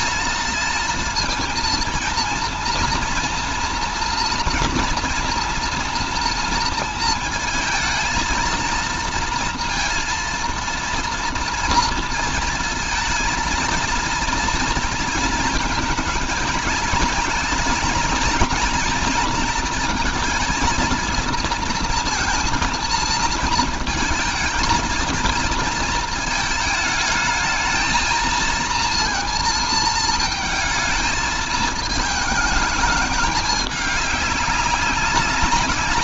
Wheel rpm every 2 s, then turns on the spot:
230, 230, 230, 230, 230, 230, 220, 230, 220, 230, 230, 230, 230, 220, 230, 220, 220, 200.
none